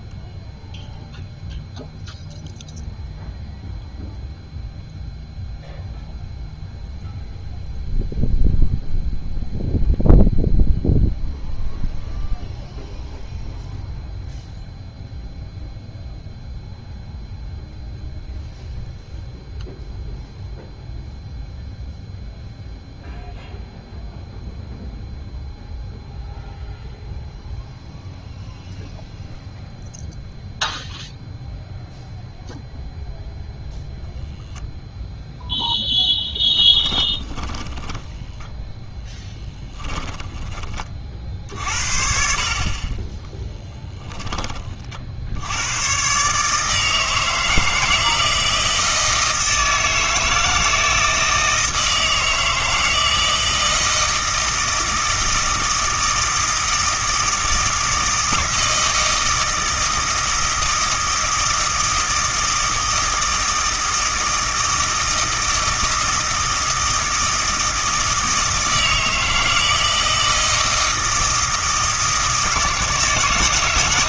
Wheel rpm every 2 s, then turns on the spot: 0, 0, 0, 0, 0, 0, 0, 0, 0, 0, 0, 0, 0, 0, 0, 0, 0, 0, 10, 10, 40, 30, 30, 150, 160, 160, 160, 160, 160, 160, 160, 160, 160, 160, 160, 160, 160.
36-40